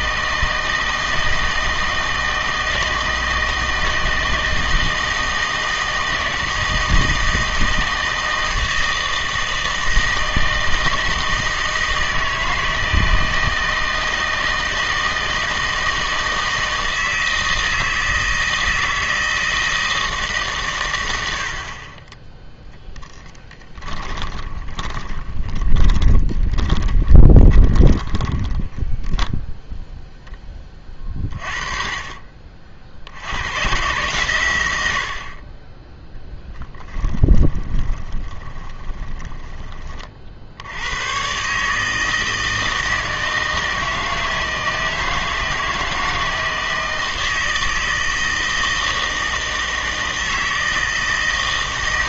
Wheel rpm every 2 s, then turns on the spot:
160, 160, 160, 160, 160, 160, 160, 160, 160, 160, 120, 0, 20, 20, 10, 30, 60, 80, 10, 20, 90, 160, 160, 160, 160, 160.
24-30 36-40